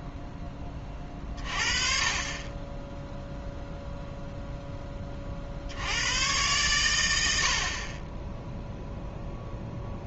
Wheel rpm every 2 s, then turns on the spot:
30, 0, 40, 90, 0.
none